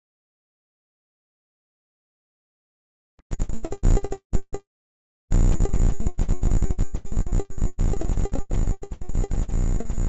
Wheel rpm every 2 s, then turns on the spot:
0, 0, 0, 0, 0.
none